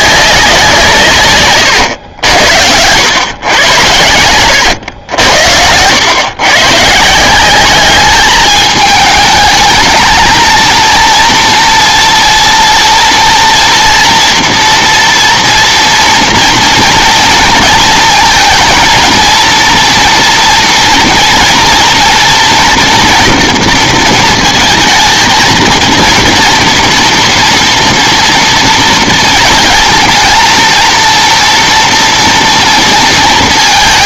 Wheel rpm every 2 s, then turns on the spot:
180, 90, 100, 130, 210, 220, 230, 230, 230, 230, 230, 230, 230, 230, 230, 230, 230.
4-6